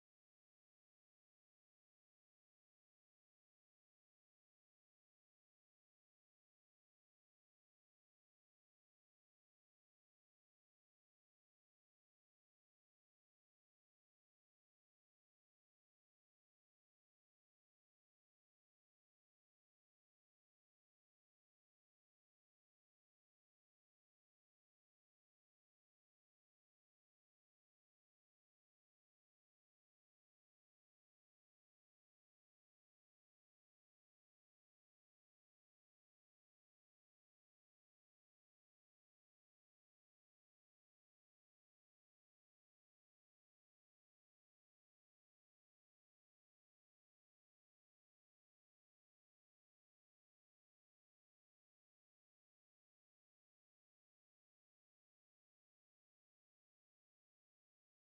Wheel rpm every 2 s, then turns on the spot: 0, 0, 0, 0, 0, 0, 0, 0, 0, 0, 0, 0, 0, 0, 0, 0, 0, 0, 0, 0, 0, 0, 0, 0, 0, 0, 0, 0, 0.
none